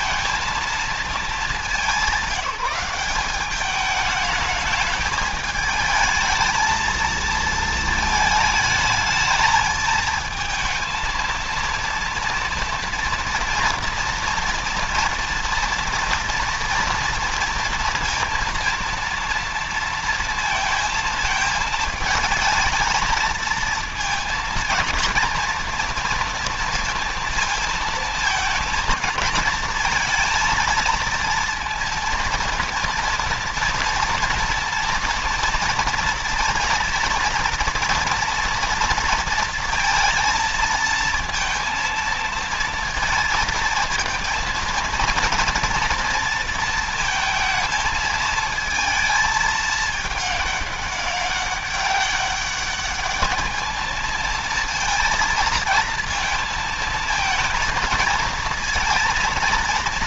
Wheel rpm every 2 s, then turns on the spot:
230, 190, 210, 220, 220, 220, 230, 230, 230, 230, 230, 220, 230, 230, 220, 230, 230, 230, 230, 240, 230, 230, 230, 230, 220, 210, 200, 220, 220, 230.
none